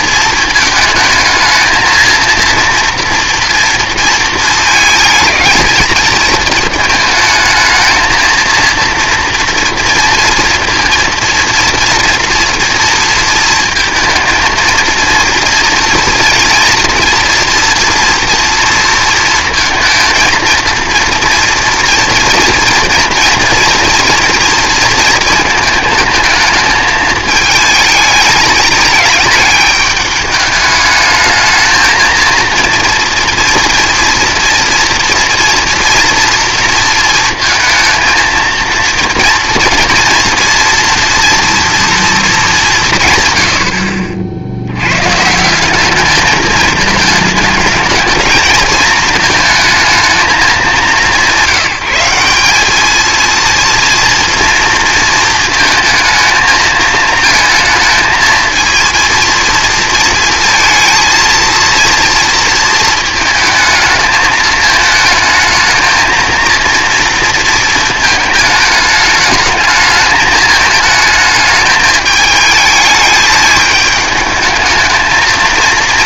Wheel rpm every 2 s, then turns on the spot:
220, 230, 220, 220, 230, 240, 230, 230, 230, 230, 230, 230, 230, 220, 210, 210, 230, 230, 230, 230, 230, 180, 80, 220, 220, 210, 210, 230, 220, 230, 230, 220, 220, 230, 210, 210, 220, 220.
none